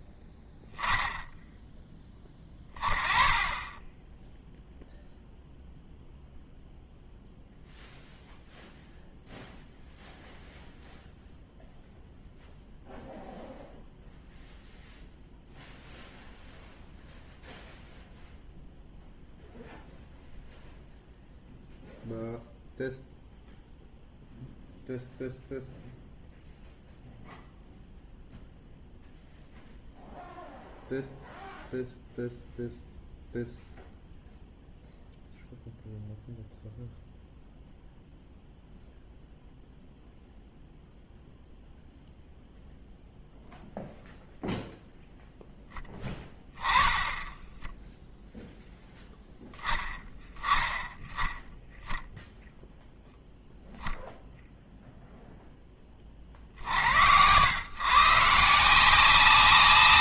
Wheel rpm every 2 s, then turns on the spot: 10, 20, 0, 0, 0, 0, 0, 0, 0, 0, 0, 0, 0, 0, 0, 0, 0, 0, 0, 0, 0, 0, 0, 10, 0, 10, 0, 0, 50, 160.
none